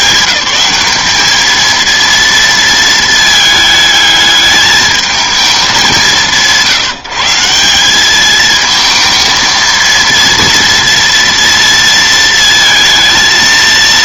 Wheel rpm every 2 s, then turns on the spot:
200, 230, 220, 140, 220, 230, 220.
none